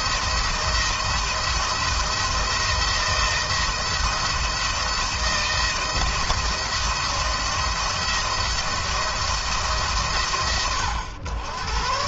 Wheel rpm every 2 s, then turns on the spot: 170, 170, 160, 170, 170, 110.
none